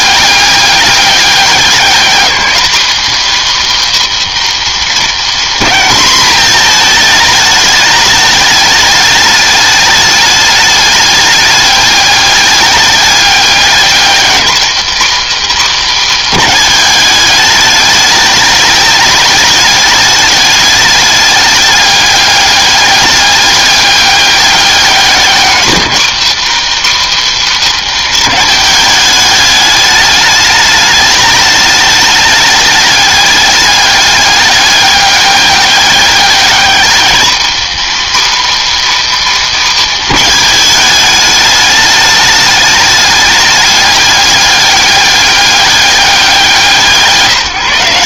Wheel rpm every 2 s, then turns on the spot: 200, 250, 220, 220, 210, 200, 200, 240, 230, 210, 210, 200, 200, 260, 210, 210, 210, 200, 210, 270, 210, 210, 200, 160.
none